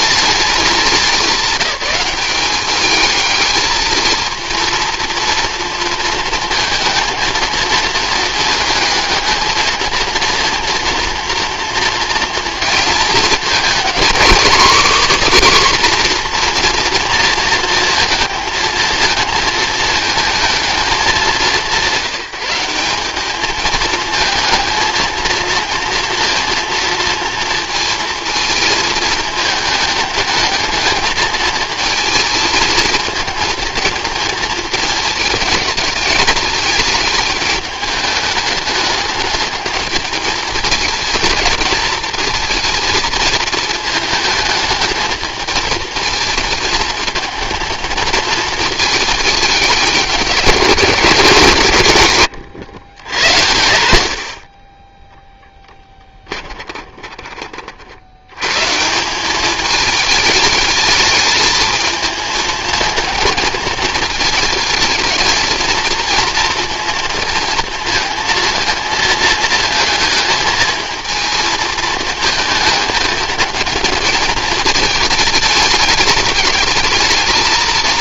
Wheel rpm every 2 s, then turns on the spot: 210, 210, 230, 230, 220, 230, 230, 270, 240, 220, 220, 190, 230, 230, 230, 210, 220, 220, 210, 210, 220, 220, 220, 220, 220, 180, 100, 20, 20, 150, 210, 220, 220, 230, 230, 220, 220, 220, 220.
56-58